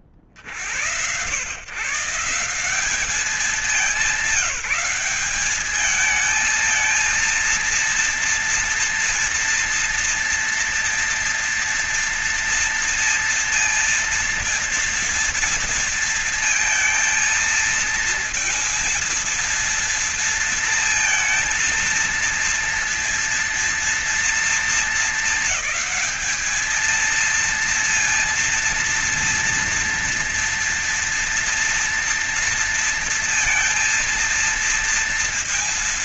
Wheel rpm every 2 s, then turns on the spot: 20, 150, 190, 220, 230, 230, 230, 230, 230, 230, 230, 230, 230, 220, 230, 230, 230, 230.
none